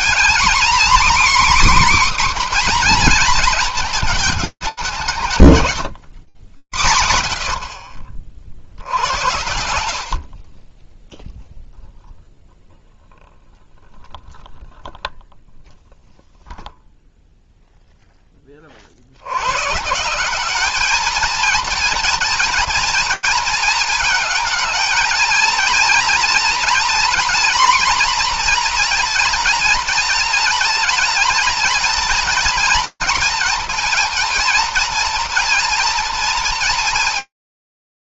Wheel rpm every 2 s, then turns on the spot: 250, 250, 200, 100, 80, 10, 0, 0, 0, 110, 220, 220, 220, 240, 230, 220, 230, 230, 230.
none